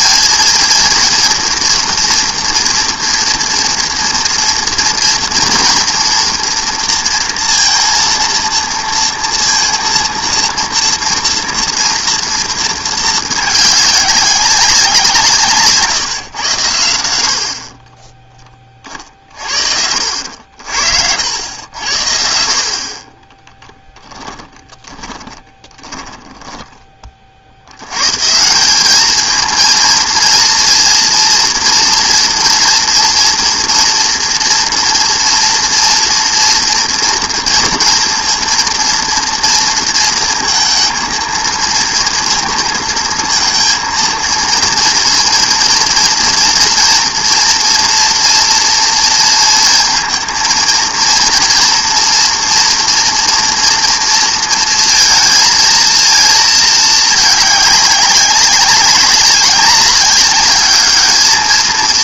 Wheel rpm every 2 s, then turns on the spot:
230, 230, 230, 230, 230, 230, 230, 190, 100, 20, 60, 50, 20, 10, 180, 230, 230, 230, 230, 230, 230, 230, 230, 230, 230, 230, 230, 230, 220, 200, 210.
20-22 24-28